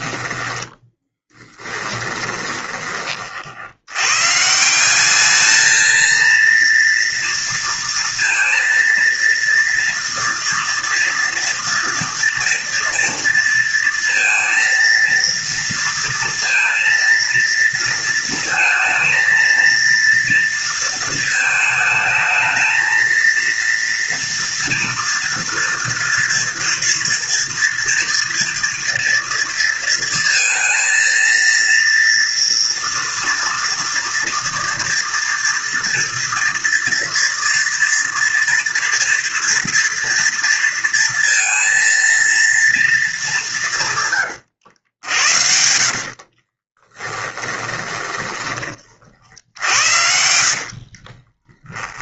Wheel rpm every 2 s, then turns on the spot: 10, 40, 190, 230, 230, 230, 230, 230, 230, 230, 220, 230, 230, 230, 230, 230, 230, 230, 230, 230, 230, 210, 80, 20, 50, 30.
0-2 44-48 50-52